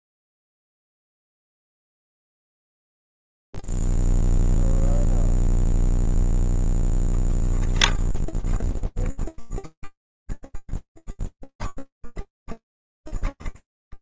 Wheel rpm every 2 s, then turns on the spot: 0, 0, 0, 0, 0, 0, 0.
none